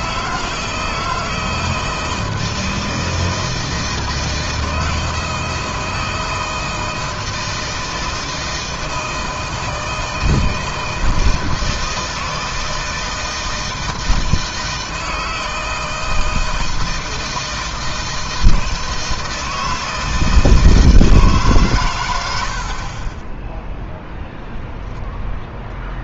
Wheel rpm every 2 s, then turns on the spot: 160, 160, 160, 160, 160, 160, 160, 160, 160, 160, 160, 80, 0.
none